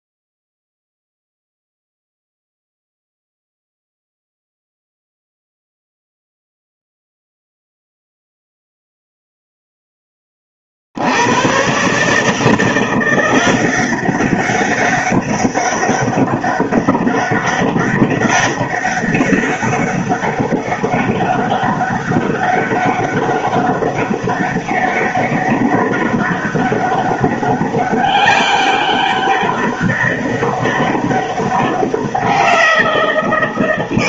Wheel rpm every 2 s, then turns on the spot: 0, 0, 0, 0, 0, 60, 170, 200, 200, 200, 200, 200, 200, 200, 200, 200, 180.
none